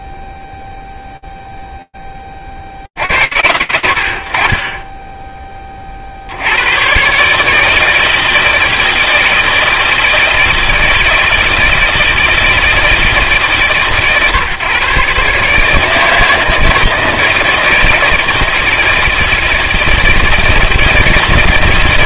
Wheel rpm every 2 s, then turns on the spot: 0, 10, 40, 100, 160, 160, 160, 130, 160, 160, 160.
none